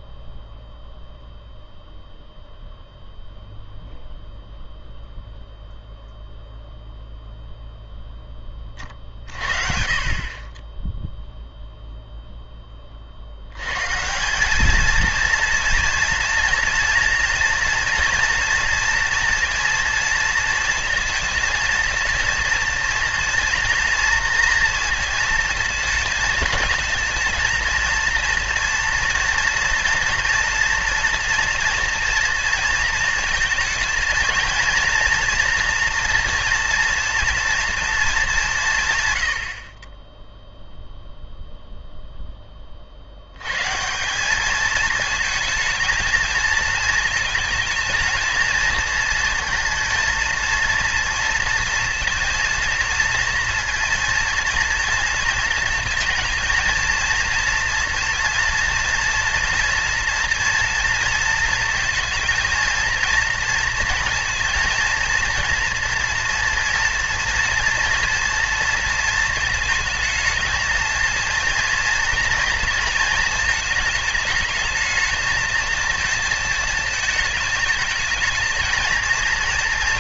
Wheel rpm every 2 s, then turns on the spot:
0, 0, 0, 0, 30, 20, 20, 210, 230, 230, 230, 230, 230, 220, 230, 230, 230, 230, 230, 160, 0, 30, 220, 220, 230, 230, 230, 230, 230, 230, 230, 230, 230, 230, 230, 220, 230, 220, 220, 230.
none